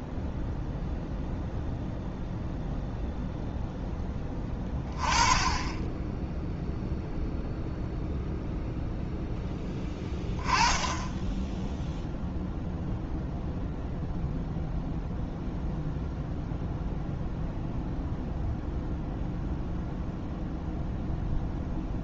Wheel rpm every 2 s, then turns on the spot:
0, 0, 20, 0, 0, 10, 0, 0, 0, 0, 0.
none